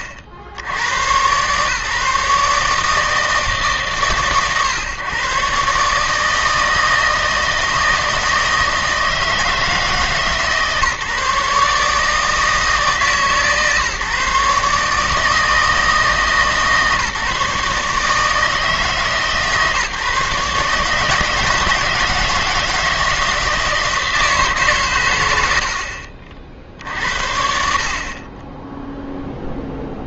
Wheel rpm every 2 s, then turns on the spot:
80, 150, 130, 160, 160, 150, 160, 150, 150, 160, 150, 160, 140, 50, 10.
none